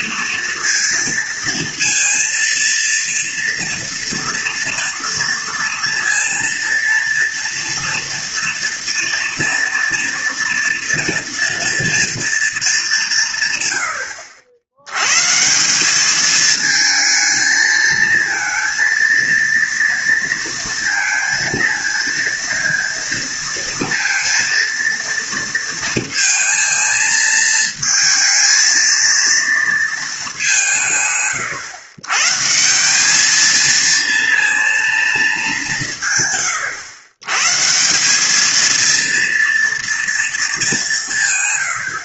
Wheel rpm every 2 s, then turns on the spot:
230, 230, 230, 230, 230, 230, 210, 90, 220, 220, 230, 230, 230, 230, 230, 180, 170, 230, 110, 230, 200.
none